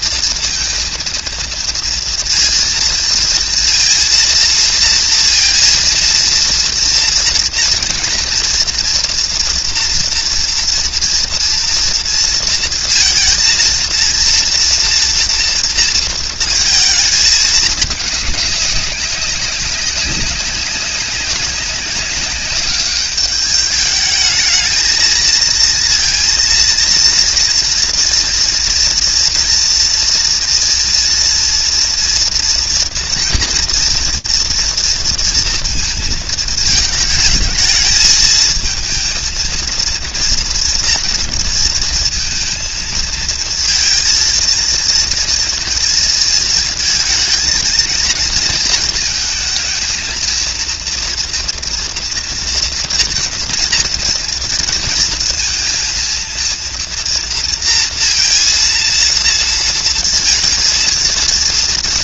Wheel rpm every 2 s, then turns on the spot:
230, 230, 230, 230, 230, 230, 230, 230, 230, 210, 190, 200, 220, 230, 230, 240, 240, 230, 220, 220, 230, 230, 230, 220, 220, 230, 240, 230, 230, 230, 230.
none